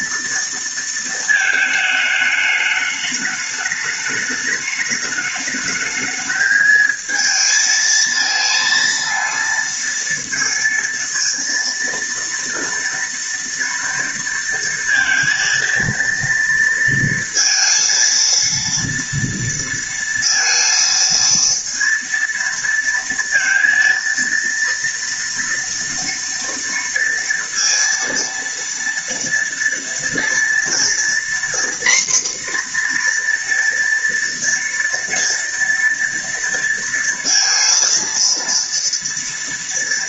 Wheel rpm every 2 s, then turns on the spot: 230, 210, 210, 220, 230, 230, 230, 230, 230, 230, 230, 230, 230, 230, 230, 240, 240, 230, 230, 230.
none